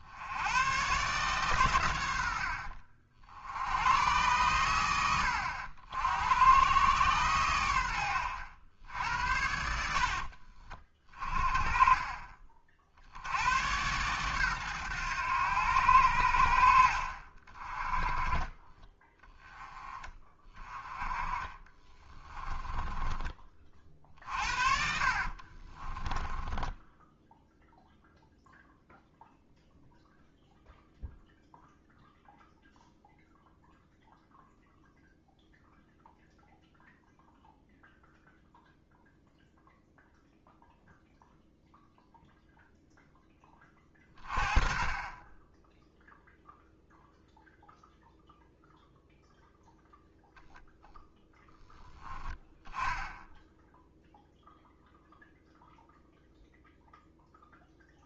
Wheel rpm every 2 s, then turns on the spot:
120, 60, 110, 120, 80, 30, 50, 110, 70, 20, 30, 20, 50, 10, 0, 0, 0, 0, 0, 0, 0, 0, 30, 0, 0, 0, 0, 0, 0.
22-28